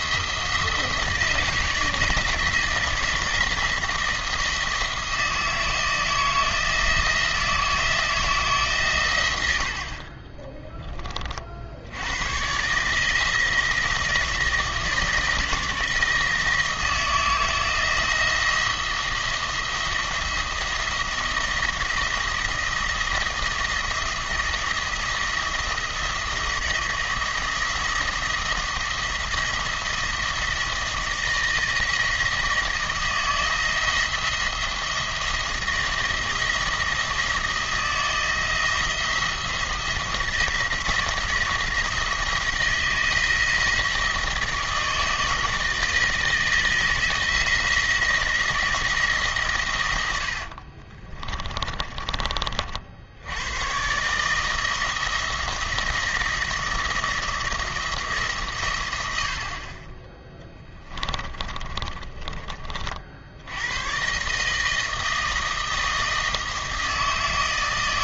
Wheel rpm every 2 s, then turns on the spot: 170, 160, 160, 160, 140, 20, 150, 160, 160, 170, 170, 170, 170, 170, 170, 160, 170, 170, 170, 170, 170, 170, 160, 170, 170, 40, 60, 160, 170, 100, 10, 40, 160, 160.
50-52 60-62